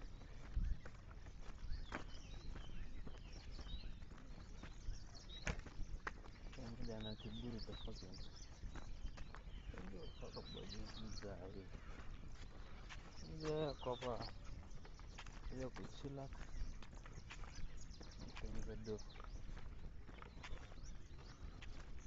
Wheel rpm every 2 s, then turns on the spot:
0, 0, 0, 0, 0, 0, 0, 0, 0, 0, 0.
none